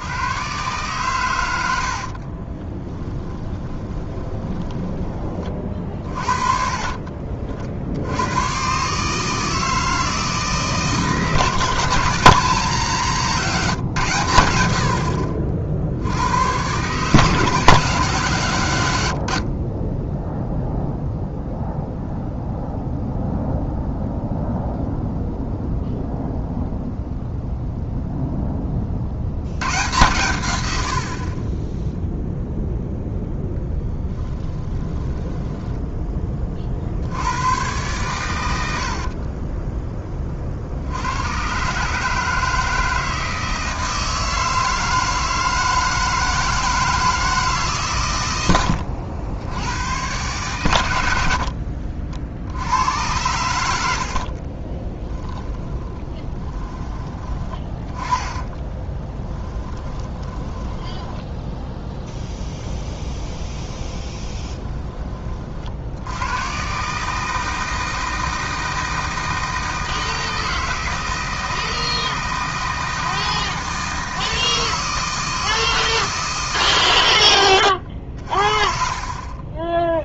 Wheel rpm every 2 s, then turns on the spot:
130, 20, 10, 40, 130, 160, 170, 80, 120, 130, 0, 0, 0, 0, 30, 90, 0, 20, 50, 70, 70, 160, 160, 160, 90, 110, 80, 20, 30, 20, 10, 10, 20, 140, 160, 160, 160, 160, 120, 40.
2-8 34-36 48-50 54-62